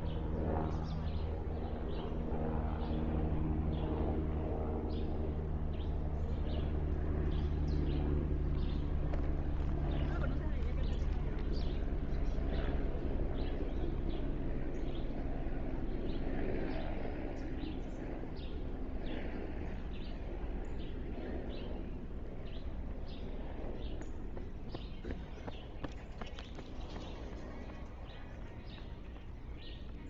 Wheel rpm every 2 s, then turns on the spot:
0, 0, 0, 0, 0, 0, 0, 0, 0, 0, 0, 0, 0, 0, 0.
none